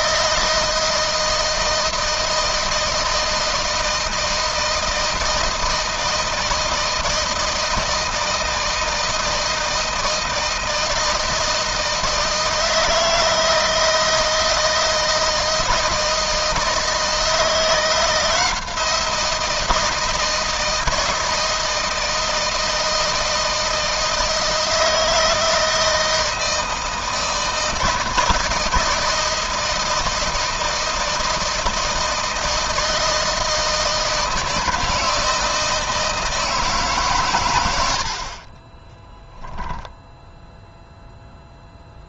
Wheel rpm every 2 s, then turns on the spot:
160, 160, 160, 160, 160, 160, 160, 160, 170, 170, 160, 160, 160, 160, 160, 160, 160, 170, 130, 20, 0.
38-40